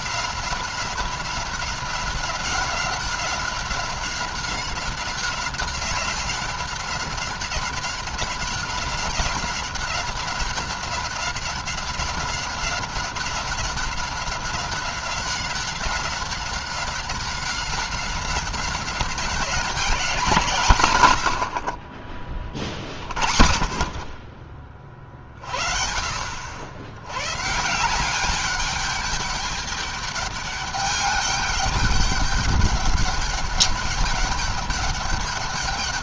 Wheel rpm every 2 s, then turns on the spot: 190, 190, 190, 190, 190, 190, 190, 190, 190, 190, 140, 50, 40, 110, 200, 210, 200, 200.
none